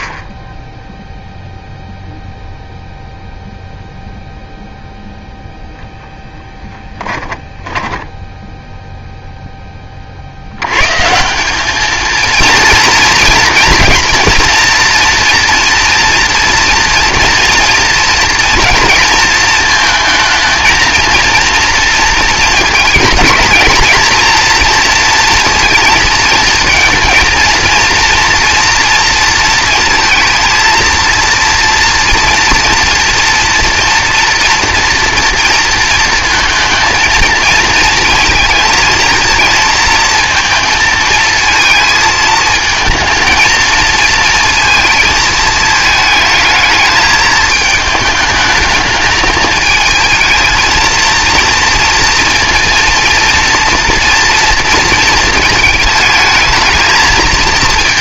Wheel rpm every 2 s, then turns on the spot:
20, 0, 0, 10, 0, 100, 230, 230, 230, 230, 220, 220, 230, 220, 230, 230, 230, 230, 230, 220, 230, 220, 220, 220, 220, 230, 230, 230, 220.
6-8